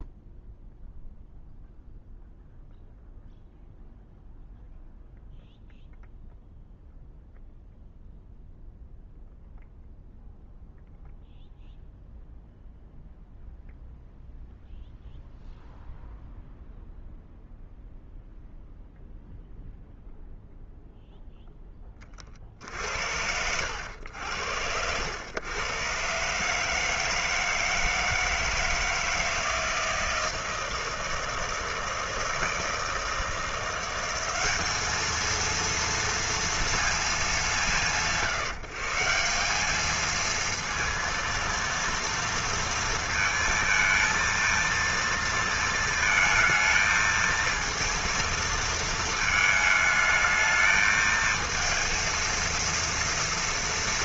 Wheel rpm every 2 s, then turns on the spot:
0, 0, 0, 0, 0, 0, 0, 0, 0, 0, 0, 60, 90, 150, 160, 160, 160, 210, 230, 150, 230, 230, 230, 220, 230, 220, 230.
22-24